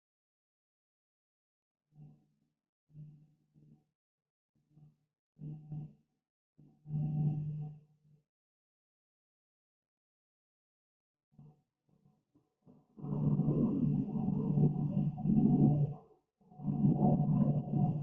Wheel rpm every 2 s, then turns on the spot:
0, 0, 0, 0, 0, 0, 0, 0, 0.
none